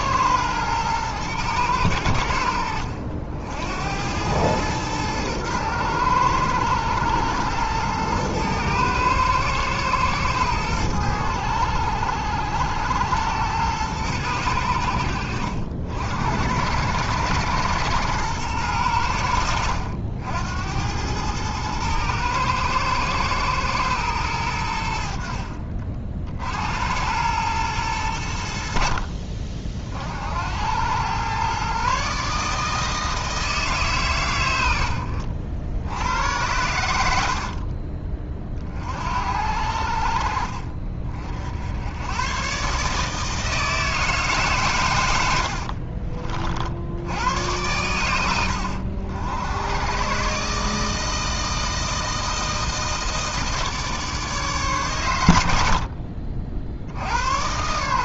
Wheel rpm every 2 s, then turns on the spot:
120, 70, 110, 110, 110, 100, 90, 80, 100, 100, 90, 110, 70, 80, 70, 90, 150, 90, 90, 50, 40, 140, 120, 60, 80, 150, 160, 140, 70.
none